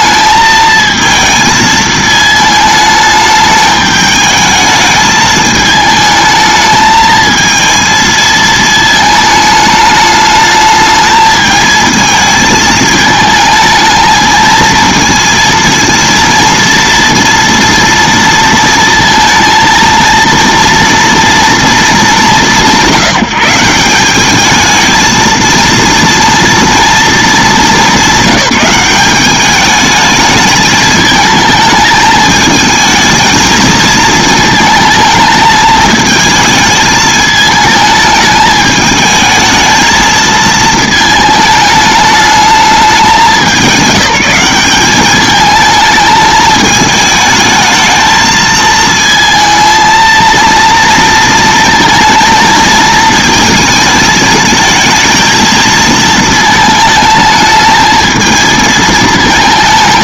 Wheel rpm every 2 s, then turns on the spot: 220, 220, 220, 220, 220, 210, 220, 230, 230, 230, 230, 140, 220, 230, 190, 210, 220, 220, 220, 210, 220, 200, 200, 220, 220, 230, 230, 220, 220, 220.
none